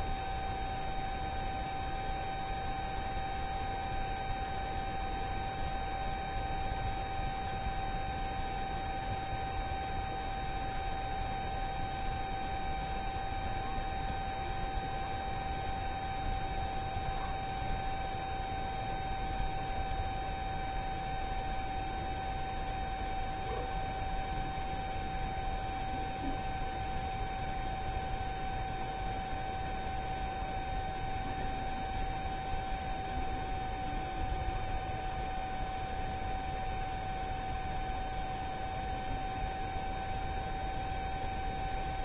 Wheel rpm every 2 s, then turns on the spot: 0, 0, 0, 0, 0, 0, 0, 0, 0, 0, 0, 0, 0, 0, 0, 0, 0, 0, 0, 0, 0.
none